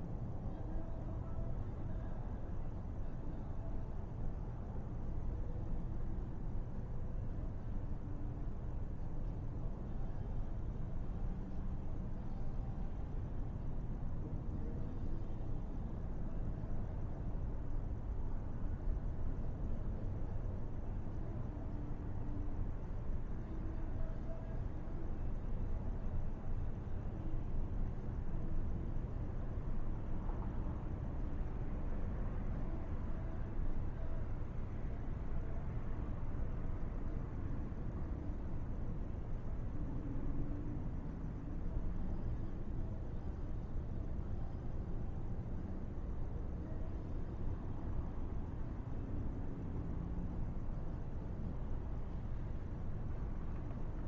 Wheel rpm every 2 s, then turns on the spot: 0, 0, 0, 0, 0, 0, 0, 0, 0, 0, 0, 0, 0, 0, 0, 0, 0, 0, 0, 0, 0, 0, 0, 0, 0, 0, 0.
none